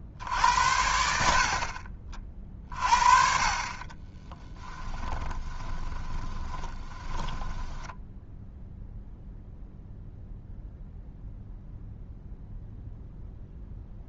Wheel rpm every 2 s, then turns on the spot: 70, 30, 20, 10, 0, 0, 0.
4-8